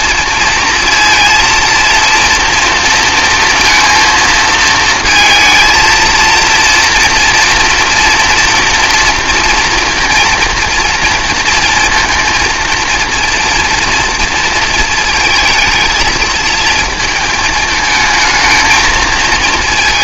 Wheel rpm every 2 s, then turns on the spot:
230, 230, 220, 230, 230, 230, 230, 230, 220, 220.
none